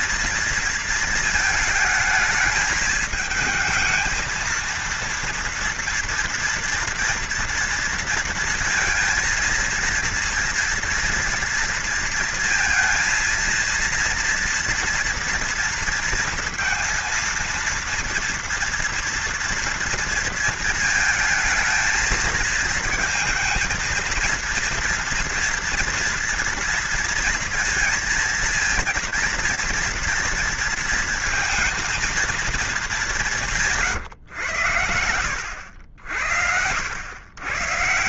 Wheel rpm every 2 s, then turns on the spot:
230, 220, 230, 230, 230, 230, 230, 230, 230, 230, 220, 220, 230, 230, 230, 230, 200, 90, 100.
none